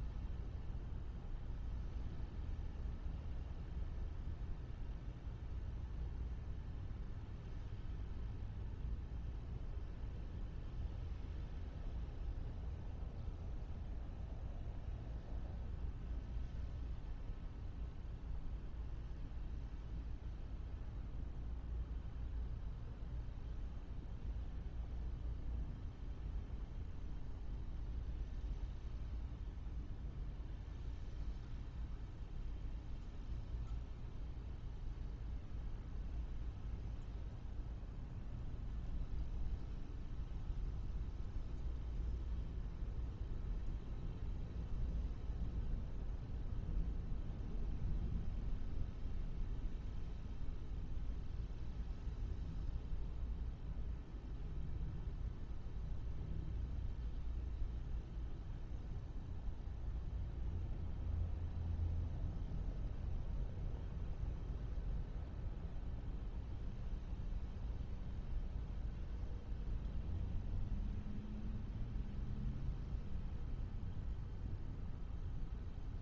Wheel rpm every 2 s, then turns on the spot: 0, 0, 0, 0, 0, 0, 0, 0, 0, 0, 0, 0, 0, 0, 0, 0, 0, 0, 0, 0, 0, 0, 0, 0, 0, 0, 0, 0, 0, 0, 0, 0, 0, 0, 0, 0, 0, 0.
none